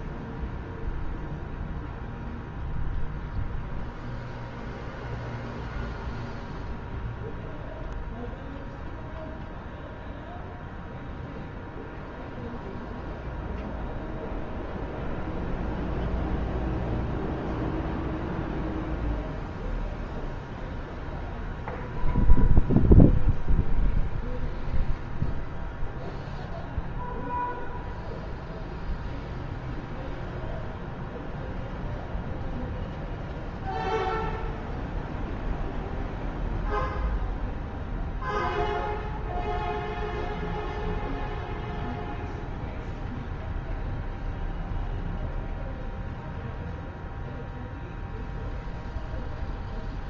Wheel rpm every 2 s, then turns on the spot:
0, 0, 0, 0, 0, 0, 0, 0, 0, 0, 0, 0, 0, 0, 0, 0, 0, 0, 0, 0, 0, 0, 0, 0, 0.
none